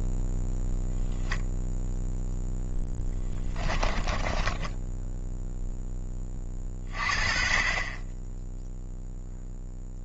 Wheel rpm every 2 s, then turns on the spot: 0, 0, 10, 30, 0.
4-6